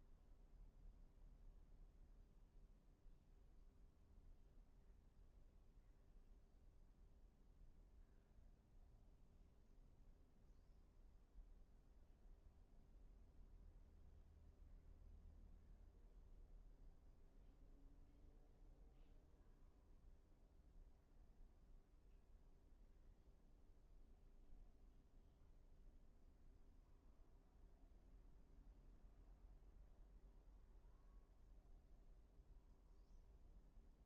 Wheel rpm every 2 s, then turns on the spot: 0, 0, 0, 0, 0, 0, 0, 0, 0, 0, 0, 0, 0, 0, 0, 0, 0.
none